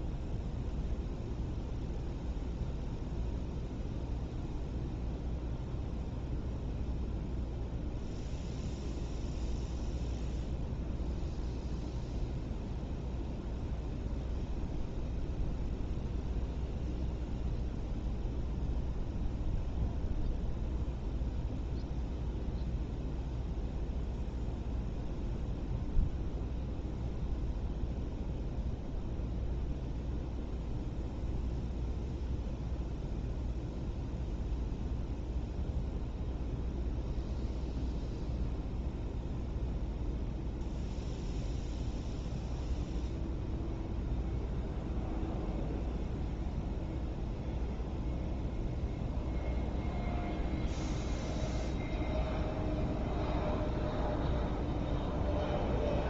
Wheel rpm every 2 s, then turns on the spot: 0, 0, 0, 0, 0, 0, 0, 0, 0, 0, 0, 0, 0, 0, 0, 0, 0, 0, 0, 0, 0, 0, 0, 0, 0, 0, 0, 0.
none